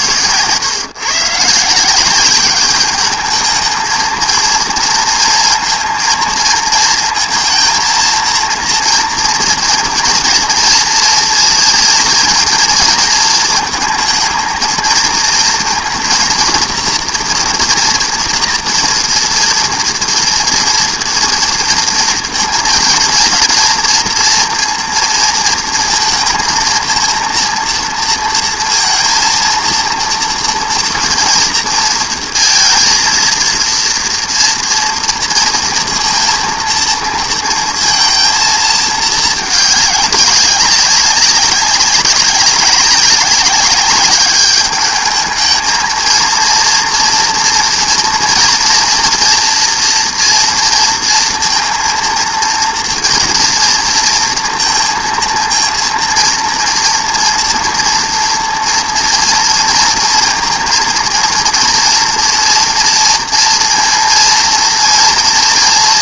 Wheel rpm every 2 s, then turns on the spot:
110, 190, 230, 220, 230, 230, 230, 220, 230, 230, 240, 230, 230, 230, 230, 230, 230, 230, 230, 230, 200, 190, 200, 230, 230, 230, 230, 230, 230, 230, 230, 240, 230.
none